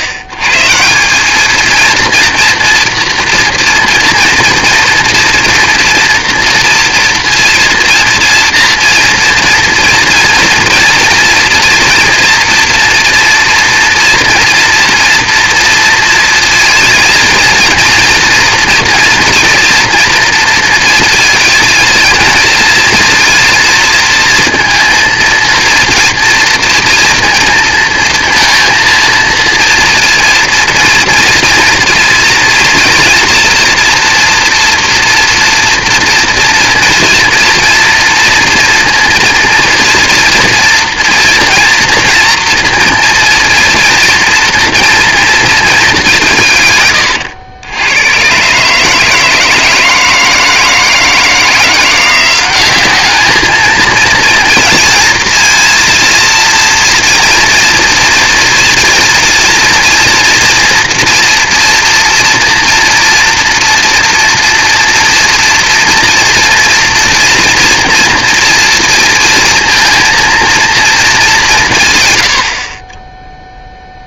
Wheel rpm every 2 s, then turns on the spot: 120, 230, 230, 230, 240, 230, 230, 230, 230, 230, 230, 230, 230, 230, 230, 230, 230, 240, 230, 230, 240, 230, 230, 130, 140, 160, 190, 230, 230, 230, 240, 230, 230, 240, 230, 230, 100.
none